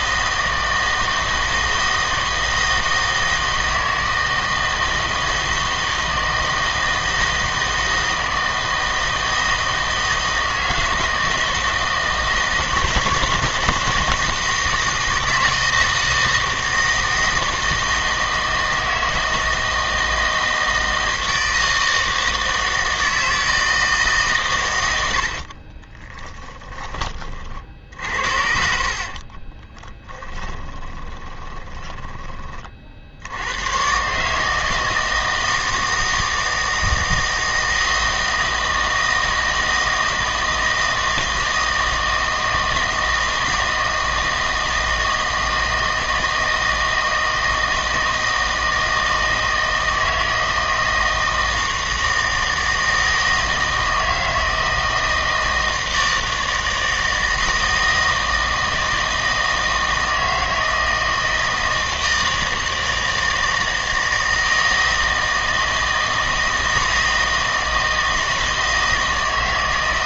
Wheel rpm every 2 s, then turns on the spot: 160, 160, 160, 160, 160, 160, 160, 160, 160, 160, 160, 160, 120, 20, 50, 10, 40, 160, 160, 160, 160, 160, 160, 160, 160, 160, 160, 160, 160, 160, 160, 160, 160, 160, 160.
30-32